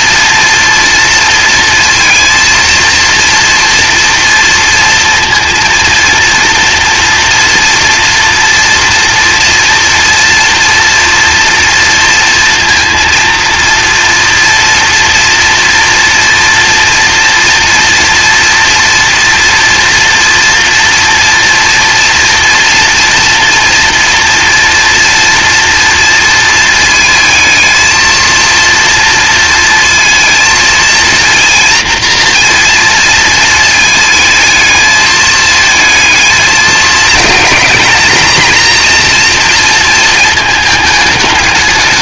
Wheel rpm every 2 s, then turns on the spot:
230, 230, 230, 230, 230, 230, 230, 230, 230, 230, 240, 230, 230, 230, 230, 230, 230, 220, 220, 230, 210.
none